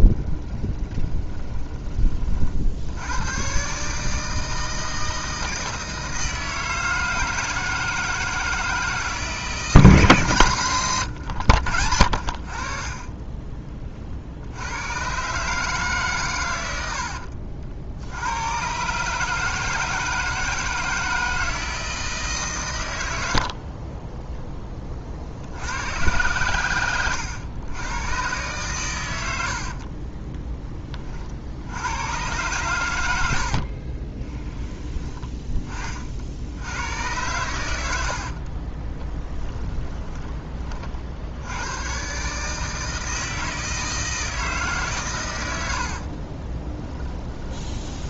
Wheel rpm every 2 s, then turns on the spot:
20, 50, 160, 160, 160, 150, 50, 80, 100, 110, 160, 130, 20, 110, 120, 10, 110, 10, 80, 40, 30, 150, 160, 40.
0-2 10-12 38-40 46-48